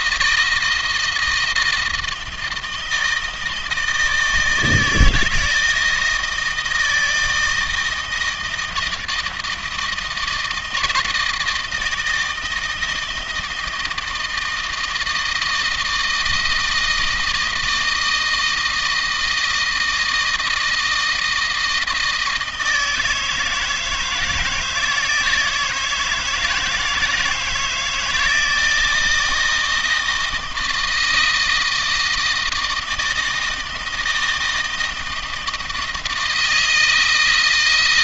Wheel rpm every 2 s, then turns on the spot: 170, 160, 160, 160, 160, 160, 160, 160, 160, 160, 160, 160, 160, 160, 160, 160, 160, 160, 160.
none